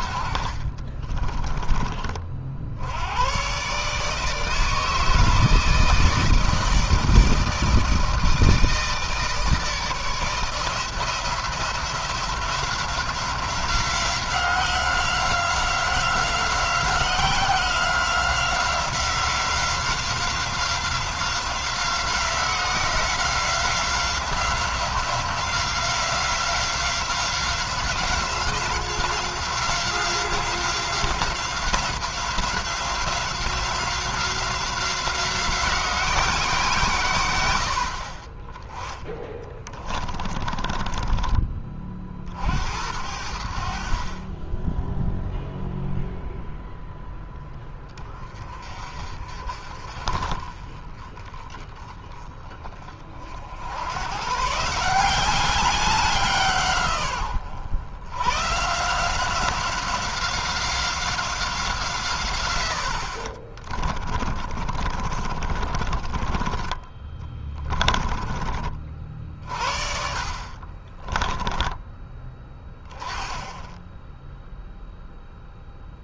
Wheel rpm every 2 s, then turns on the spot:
40, 60, 160, 160, 160, 170, 180, 180, 180, 180, 180, 180, 180, 190, 180, 180, 180, 180, 150, 20, 30, 60, 10, 0, 40, 30, 30, 160, 150, 150, 180, 100, 50, 20, 30, 30, 20, 0.
0-2 40-42 64-68 70-72